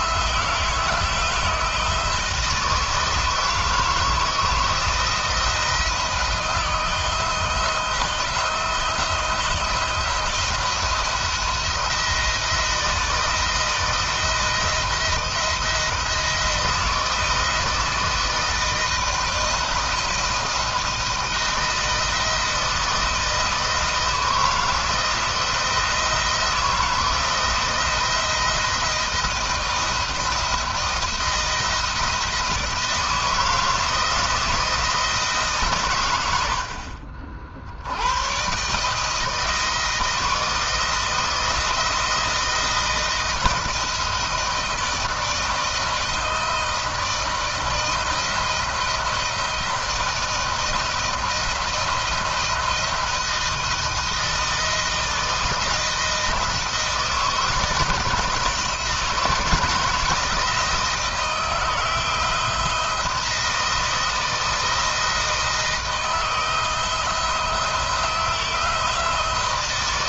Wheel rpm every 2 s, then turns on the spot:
160, 160, 160, 160, 160, 170, 160, 170, 170, 160, 160, 160, 160, 160, 170, 160, 160, 160, 70, 150, 160, 160, 160, 160, 170, 170, 160, 160, 160, 160, 160, 170, 170, 170, 170.
none